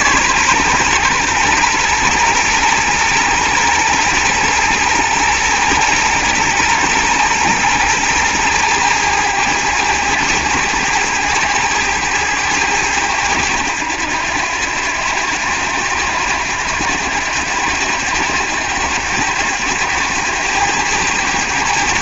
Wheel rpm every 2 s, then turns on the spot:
130, 120, 120, 120, 110, 100, 100, 90, 90, 100, 100.
none